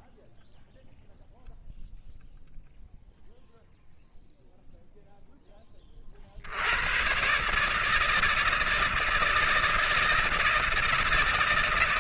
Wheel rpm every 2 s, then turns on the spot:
0, 0, 0, 90, 160, 160.
none